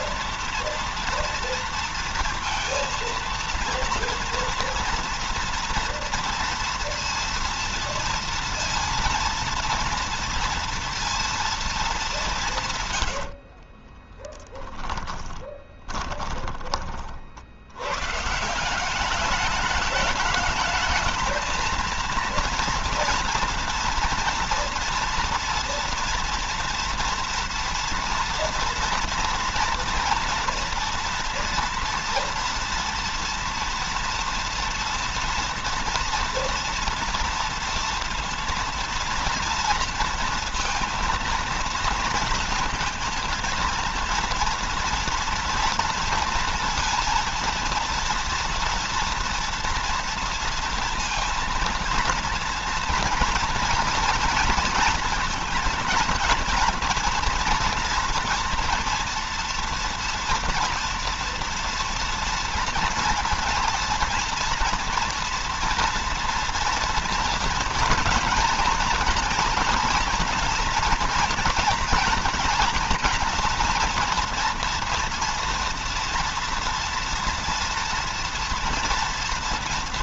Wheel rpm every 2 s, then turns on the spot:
230, 230, 230, 230, 230, 230, 130, 10, 30, 170, 210, 230, 230, 230, 230, 230, 230, 230, 230, 230, 230, 220, 230, 230, 230, 230, 230, 240, 230, 240, 230, 230, 240, 230, 240, 230, 230, 230, 230, 230.
12-16